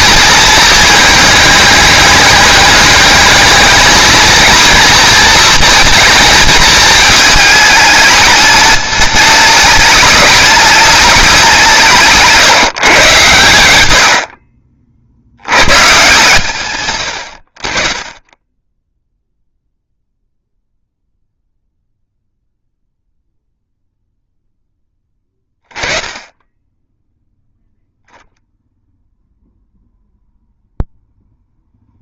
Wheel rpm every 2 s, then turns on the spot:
220, 220, 230, 220, 210, 210, 150, 40, 120, 10, 0, 0, 10, 10, 0, 0.
none